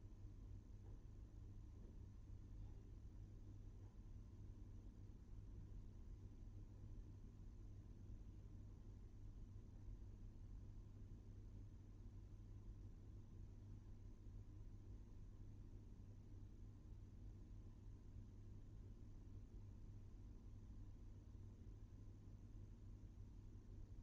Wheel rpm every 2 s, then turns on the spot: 0, 0, 0, 0, 0, 0, 0, 0, 0, 0, 0, 0.
none